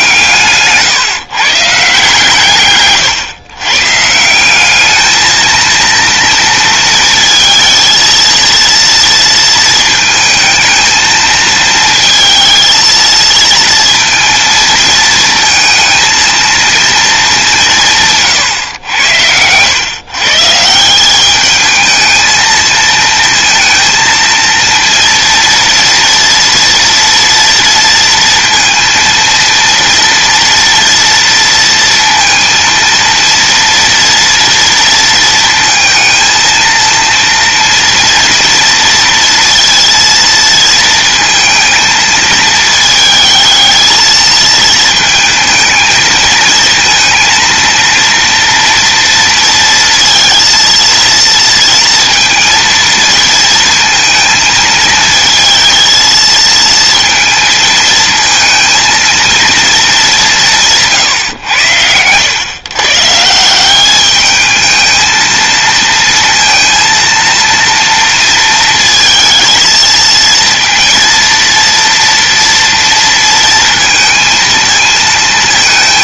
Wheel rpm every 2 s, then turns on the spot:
150, 120, 220, 230, 230, 220, 220, 230, 220, 90, 200, 230, 230, 230, 230, 230, 230, 230, 230, 230, 230, 220, 220, 230, 230, 230, 230, 230, 230, 230, 140, 150, 220, 230, 230, 230, 230, 220.
none